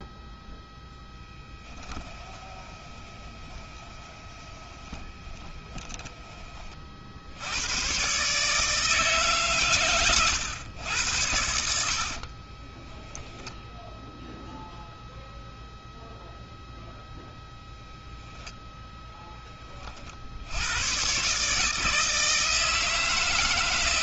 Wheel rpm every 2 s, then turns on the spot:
0, 20, 20, 30, 130, 120, 30, 0, 0, 0, 60, 160.
2-6 12-14